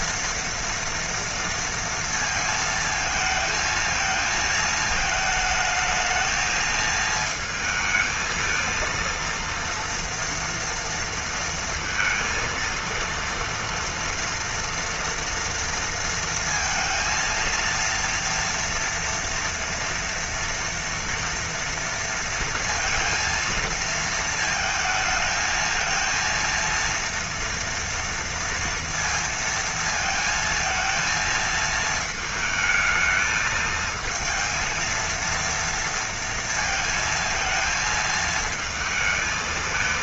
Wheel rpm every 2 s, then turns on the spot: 230, 230, 220, 220, 220, 230, 230, 230, 230, 230, 230, 230, 230, 230, 230, 230, 220, 230, 230, 220.
none